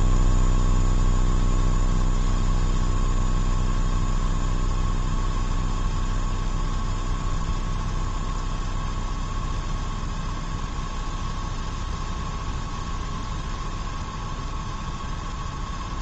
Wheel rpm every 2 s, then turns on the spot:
0, 0, 0, 0, 0, 0, 0, 0.
none